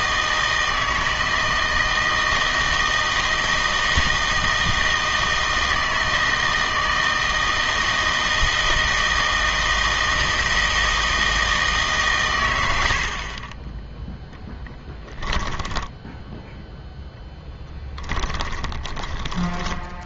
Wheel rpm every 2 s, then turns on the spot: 160, 160, 160, 160, 160, 160, 100, 10, 0, 10.
18-20